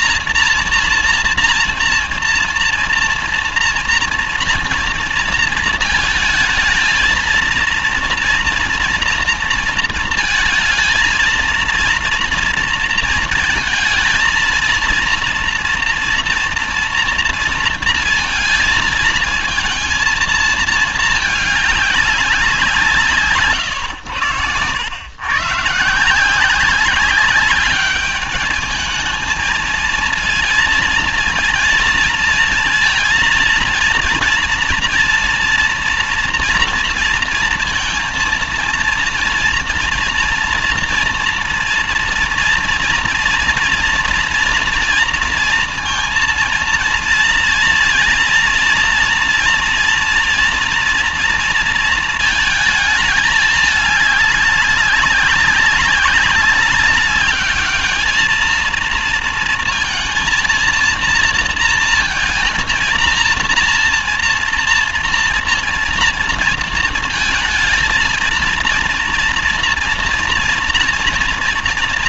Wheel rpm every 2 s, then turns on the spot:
230, 230, 230, 230, 230, 220, 230, 230, 240, 230, 220, 160, 100, 190, 210, 230, 230, 230, 230, 230, 230, 230, 230, 230, 230, 230, 220, 200, 200, 220, 230, 220, 230, 230, 230, 230.
none